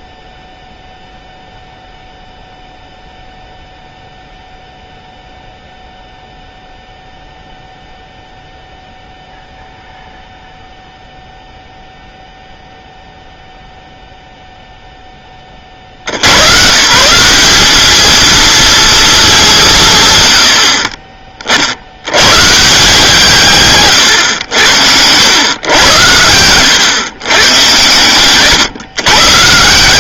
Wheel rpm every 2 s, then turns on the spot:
0, 0, 0, 0, 0, 0, 0, 0, 130, 230, 60, 150, 90, 100, 120.
none